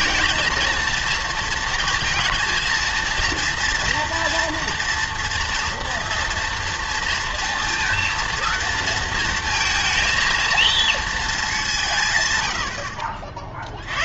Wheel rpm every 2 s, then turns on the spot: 230, 230, 230, 230, 230, 230, 90.
none